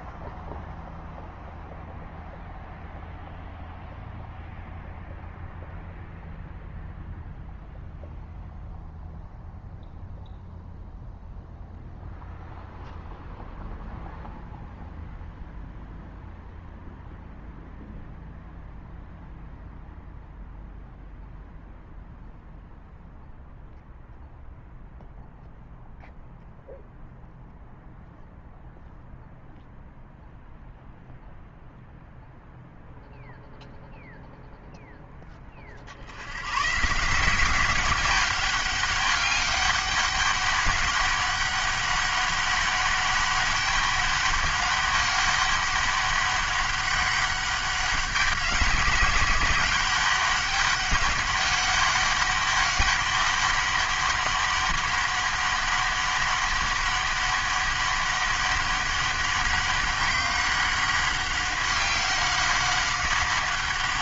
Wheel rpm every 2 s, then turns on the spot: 0, 0, 0, 0, 0, 0, 0, 0, 0, 0, 0, 0, 0, 0, 0, 0, 0, 10, 130, 200, 200, 200, 200, 200, 200, 200, 200, 200, 200, 200, 190, 190.
none